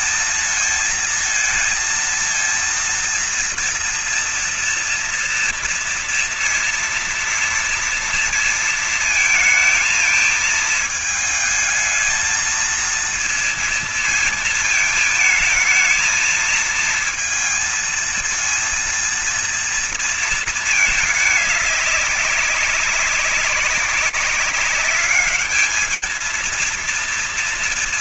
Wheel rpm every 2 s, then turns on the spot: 230, 230, 230, 240, 230, 220, 220, 230, 220, 230, 230, 210, 190, 210.
none